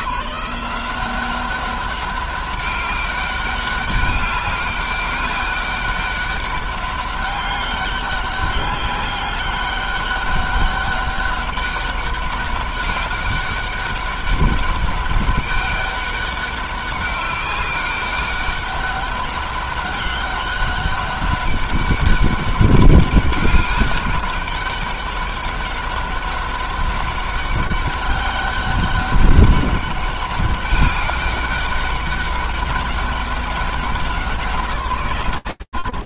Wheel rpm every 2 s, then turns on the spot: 190, 200, 200, 200, 200, 200, 200, 200, 200, 200, 190, 200, 200, 200, 200, 200, 200, 180.
none